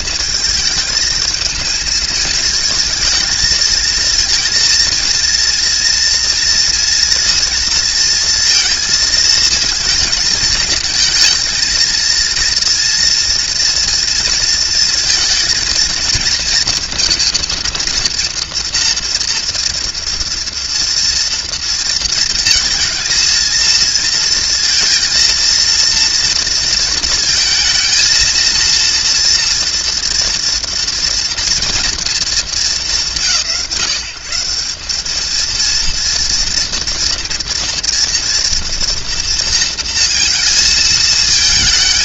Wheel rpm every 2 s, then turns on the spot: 220, 230, 220, 230, 230, 230, 230, 230, 230, 230, 230, 230, 230, 230, 230, 230, 160, 180, 230, 230, 230.
none